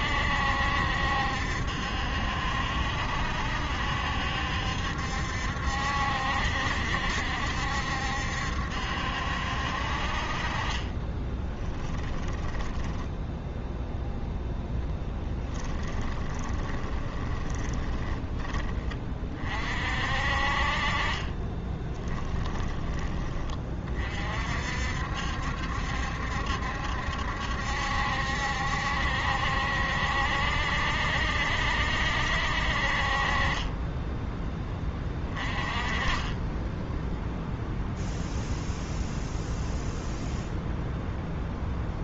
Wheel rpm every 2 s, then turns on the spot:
70, 70, 70, 70, 70, 30, 10, 10, 20, 20, 40, 20, 60, 70, 70, 70, 50, 20, 10, 0, 0.
10-18